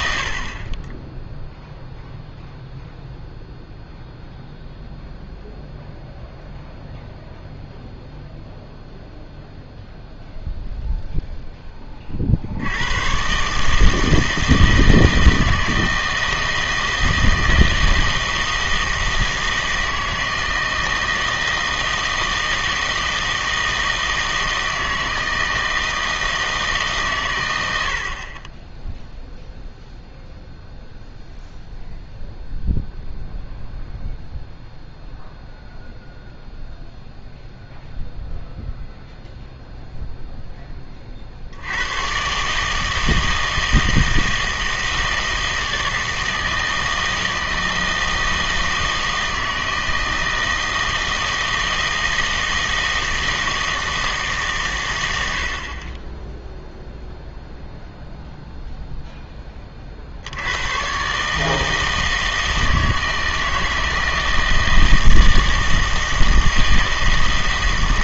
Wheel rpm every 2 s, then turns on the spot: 20, 0, 0, 0, 0, 0, 90, 160, 160, 160, 160, 160, 160, 150, 10, 0, 0, 0, 0, 0, 10, 150, 160, 160, 160, 160, 160, 110, 0, 0, 110, 160, 160, 160.
none